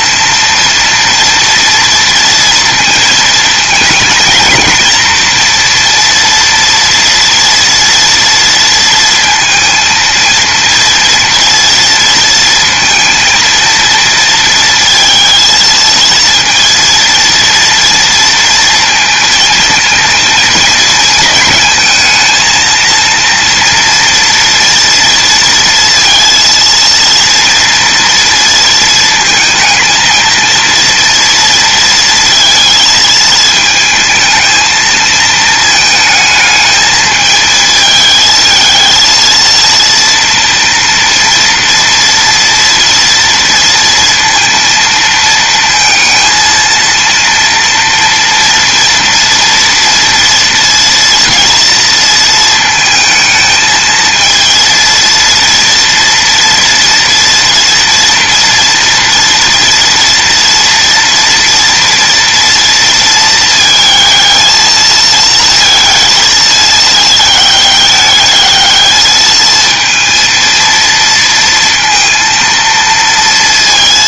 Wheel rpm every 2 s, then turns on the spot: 230, 230, 230, 230, 230, 230, 230, 230, 230, 230, 220, 230, 230, 230, 230, 230, 220, 220, 220, 220, 230, 230, 230, 230, 230, 230, 220, 230, 230, 240, 230, 230, 220, 220, 220, 230, 230.
none